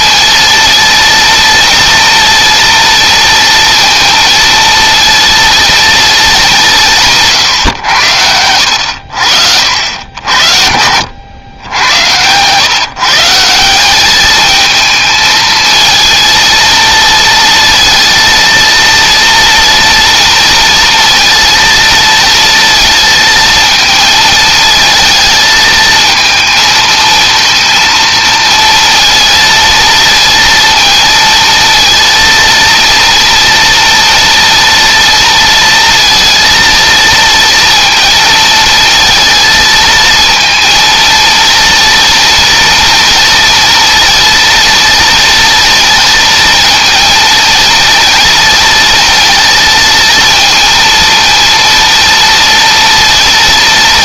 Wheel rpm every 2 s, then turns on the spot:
230, 230, 230, 180, 80, 80, 140, 220, 230, 230, 230, 230, 220, 220, 230, 230, 230, 230, 230, 230, 230, 230, 240, 230, 230, 230, 230.
none